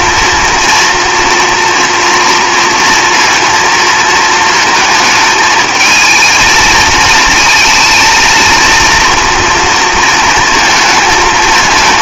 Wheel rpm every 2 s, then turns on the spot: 230, 230, 220, 220, 230, 230.
none